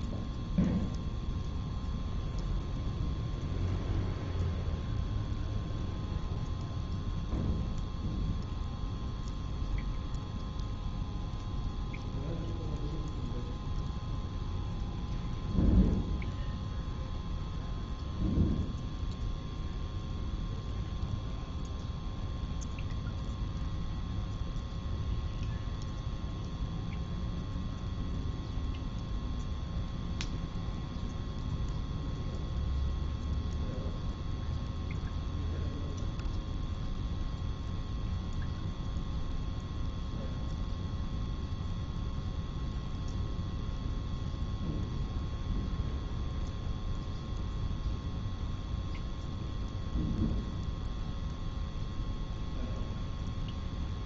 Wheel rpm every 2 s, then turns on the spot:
0, 0, 0, 0, 0, 0, 0, 0, 0, 0, 0, 0, 0, 0, 0, 0, 0, 0, 0, 0, 0, 0, 0, 0, 0, 0, 0.
none